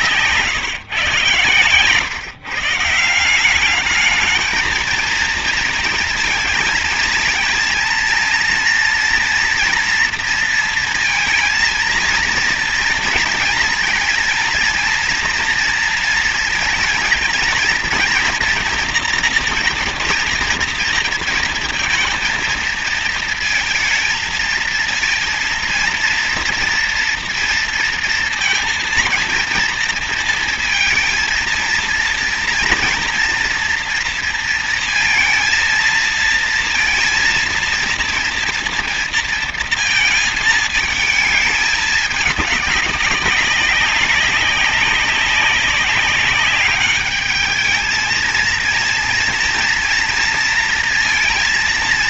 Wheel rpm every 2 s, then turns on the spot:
150, 160, 220, 230, 240, 230, 230, 230, 230, 230, 230, 230, 230, 230, 230, 230, 230, 230, 230, 230, 220, 200, 200, 210, 230, 230.
none